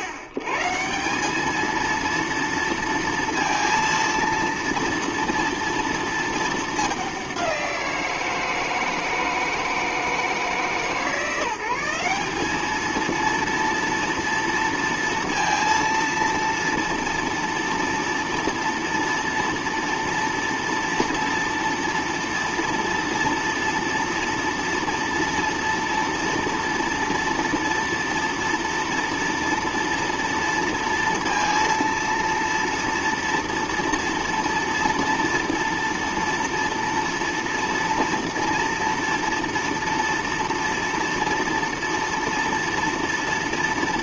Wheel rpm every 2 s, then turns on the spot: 120, 230, 230, 220, 160, 160, 210, 230, 230, 230, 230, 230, 230, 230, 230, 230, 230, 240, 230, 230, 230, 230.
none